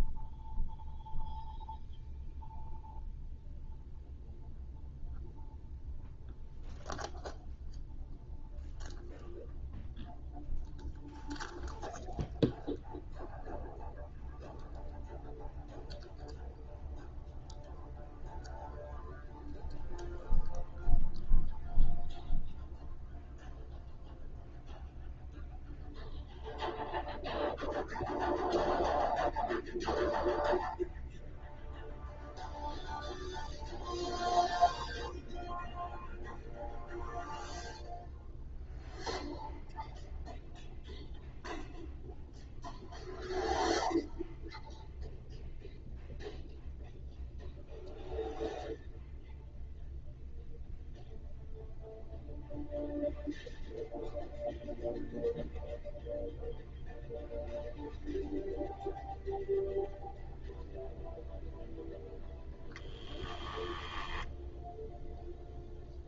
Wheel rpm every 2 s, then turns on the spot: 0, 0, 0, 0, 0, 0, 0, 0, 0, 0, 0, 0, 0, 0, 0, 0, 0, 0, 0, 0, 0, 0, 0, 0, 0, 0, 0, 0, 0, 0, 0, 10, 0.
none